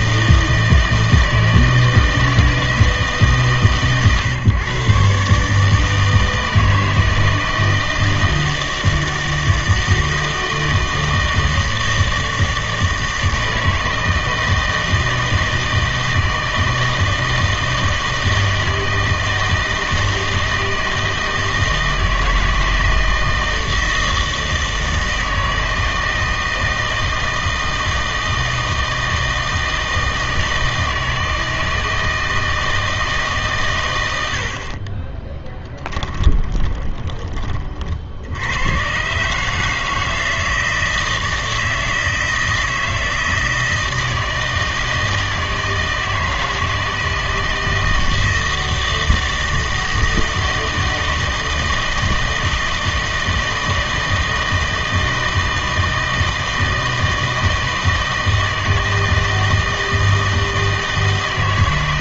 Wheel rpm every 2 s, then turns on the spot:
160, 160, 120, 160, 160, 160, 160, 160, 160, 160, 160, 160, 160, 160, 160, 160, 160, 50, 20, 90, 160, 160, 160, 160, 160, 160, 160, 160, 160, 160, 160.
36-38